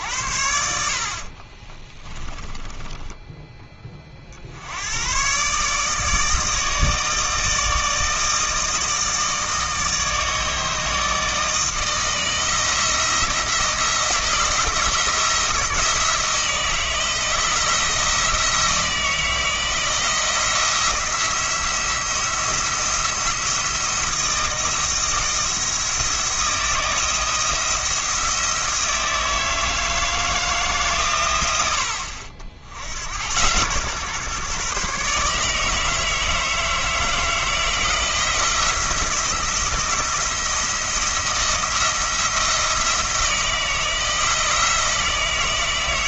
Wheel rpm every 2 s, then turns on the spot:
60, 20, 60, 160, 160, 160, 160, 170, 160, 160, 170, 170, 170, 170, 170, 150, 80, 140, 160, 170, 170, 170, 160.
2-4